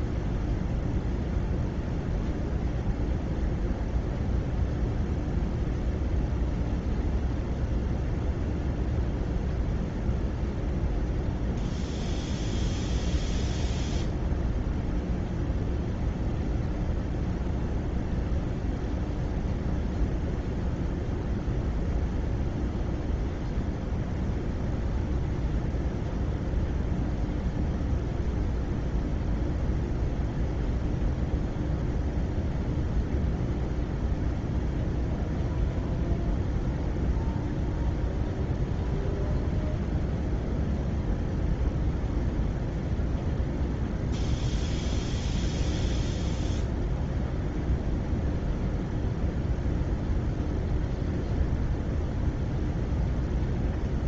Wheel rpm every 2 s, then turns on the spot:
0, 0, 0, 0, 0, 0, 0, 0, 0, 0, 0, 0, 0, 0, 0, 0, 0, 0, 0, 0, 0, 0, 0, 0, 0, 0, 0.
none